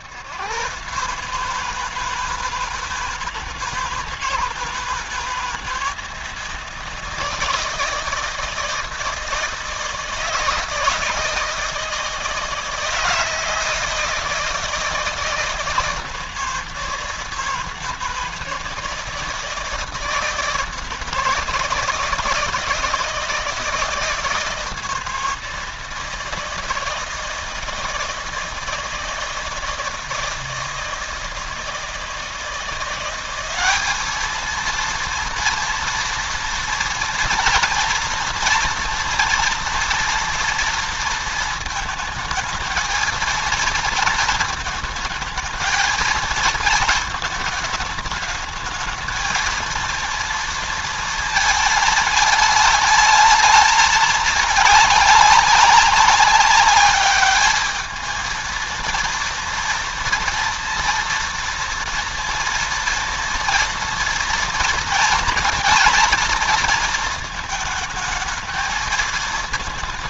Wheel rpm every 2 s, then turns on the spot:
130, 160, 160, 160, 160, 160, 160, 160, 160, 160, 160, 160, 170, 160, 160, 160, 170, 230, 230, 240, 230, 220, 220, 220, 220, 230, 220, 210, 200, 230, 230, 230, 230, 230, 220.
none